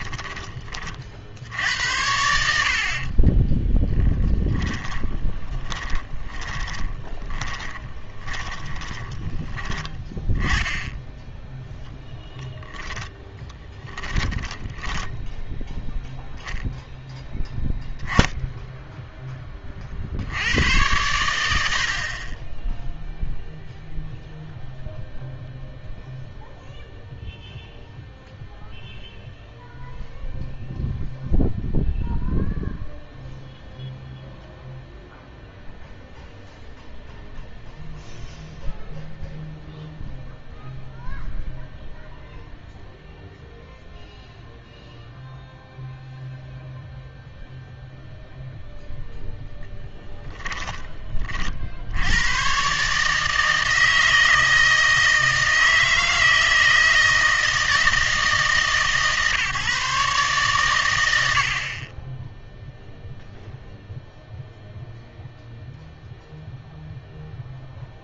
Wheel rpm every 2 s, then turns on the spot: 30, 70, 10, 20, 20, 20, 10, 10, 0, 0, 100, 10, 0, 0, 0, 0, 0, 0, 0, 0, 0, 0, 0, 0, 0, 10, 130, 160, 160, 140, 120, 0, 0, 0.
4-10 12-16